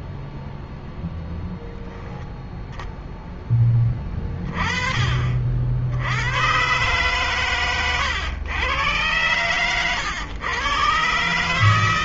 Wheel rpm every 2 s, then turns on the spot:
0, 0, 30, 120, 100, 120.
none